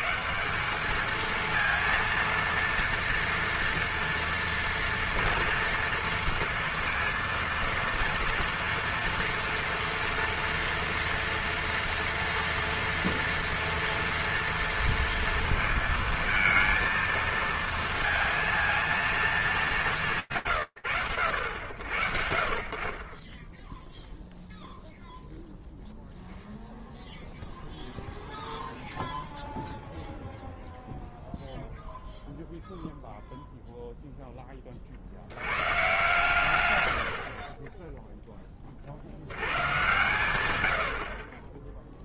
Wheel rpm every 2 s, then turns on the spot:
190, 230, 230, 230, 230, 230, 230, 230, 230, 230, 100, 50, 0, 0, 0, 0, 0, 60, 80, 60, 70.
none